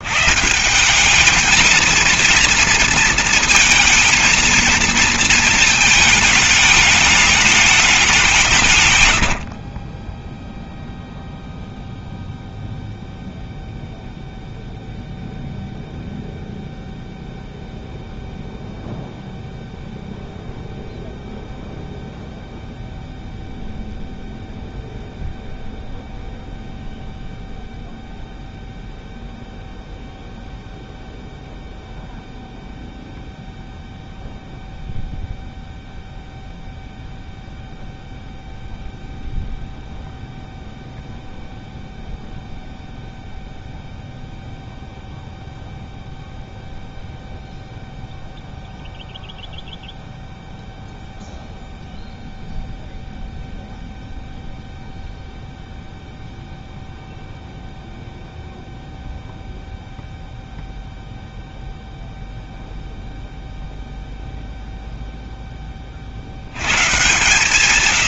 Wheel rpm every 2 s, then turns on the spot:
180, 230, 230, 210, 140, 0, 0, 0, 0, 0, 0, 0, 0, 0, 0, 0, 0, 0, 0, 0, 0, 0, 0, 0, 0, 0, 0, 0, 0, 0, 0, 0, 0, 120.
none